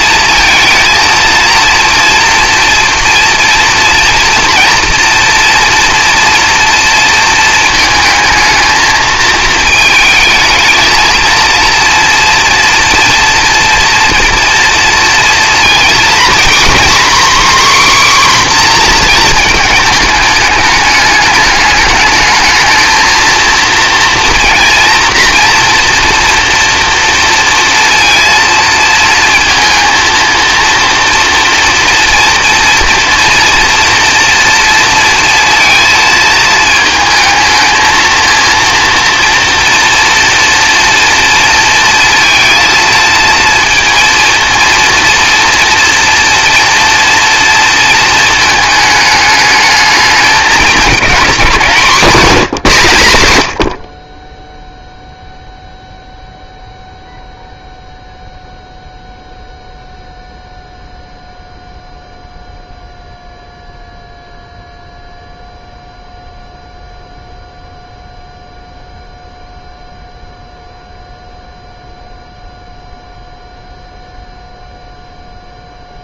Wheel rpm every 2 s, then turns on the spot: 230, 230, 230, 230, 220, 220, 230, 230, 260, 250, 210, 220, 230, 230, 230, 230, 230, 230, 220, 230, 240, 230, 230, 230, 220, 210, 170, 0, 0, 0, 0, 0, 0, 0, 0, 0, 0, 0.
none